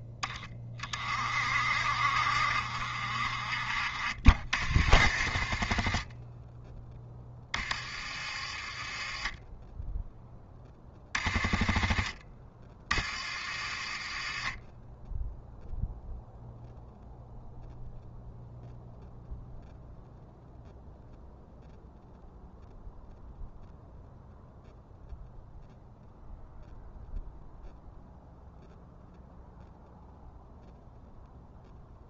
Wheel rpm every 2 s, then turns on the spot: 20, 50, 50, 10, 20, 20, 30, 10, 0, 0, 0, 0, 0, 0, 0, 0.
none